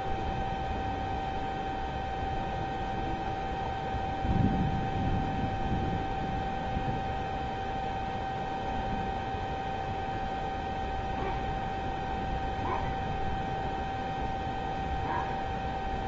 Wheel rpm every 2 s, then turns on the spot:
0, 0, 0, 0, 0, 0, 0, 0.
none